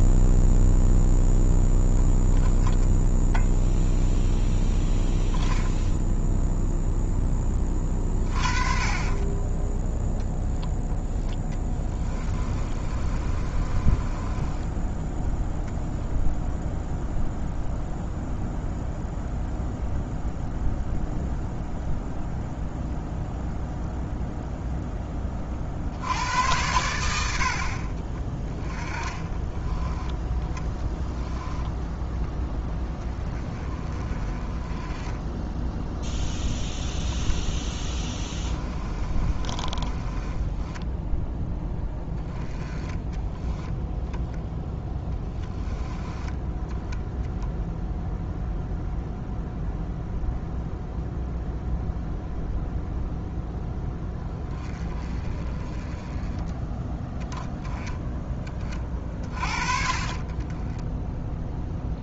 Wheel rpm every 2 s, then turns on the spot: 0, 0, 0, 0, 30, 0, 30, 10, 0, 0, 0, 0, 10, 90, 20, 10, 10, 20, 10, 30, 10, 20, 10, 0, 0, 0, 0, 20, 10, 40, 10.
12-14 28-32 38-40